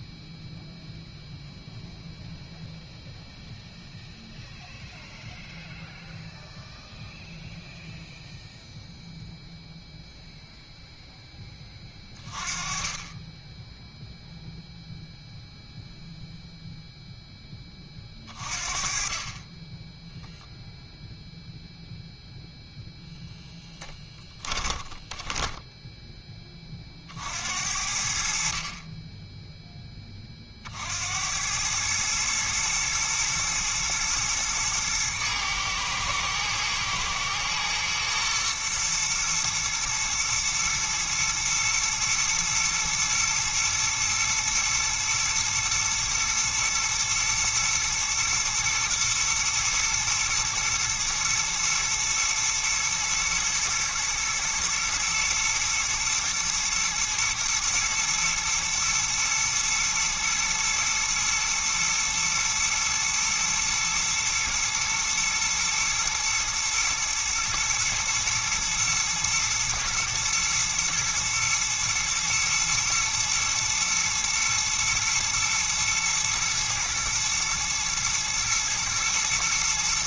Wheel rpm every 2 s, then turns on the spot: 0, 0, 0, 0, 0, 10, 30, 0, 0, 30, 0, 0, 20, 50, 20, 70, 110, 110, 120, 120, 110, 120, 110, 110, 110, 110, 120, 120, 120, 120, 120, 120, 120, 120, 120, 120, 110, 110, 110, 110.
24-26